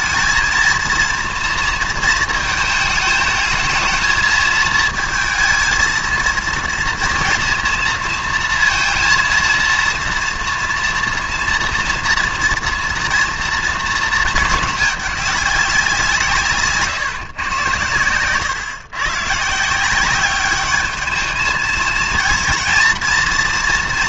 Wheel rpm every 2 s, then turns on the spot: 230, 220, 220, 230, 230, 230, 230, 220, 150, 120, 210, 230.
none